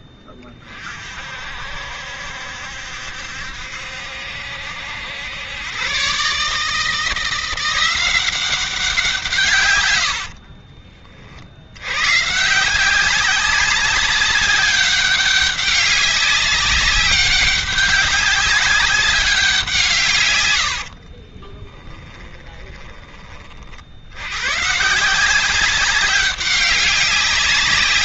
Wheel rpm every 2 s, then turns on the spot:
40, 70, 80, 150, 180, 40, 170, 200, 190, 200, 80, 20, 130, 200.
20-22